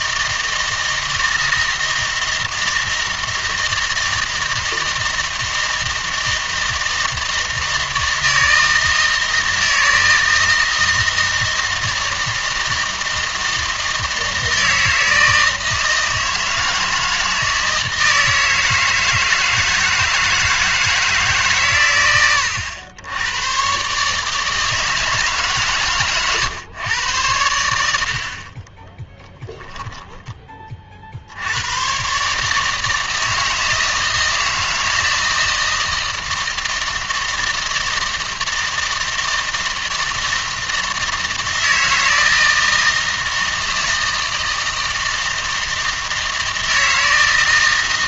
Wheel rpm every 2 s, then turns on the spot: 160, 160, 160, 160, 160, 160, 160, 160, 160, 160, 160, 90, 160, 110, 20, 30, 160, 160, 160, 160, 160, 160, 160, 160.
28-30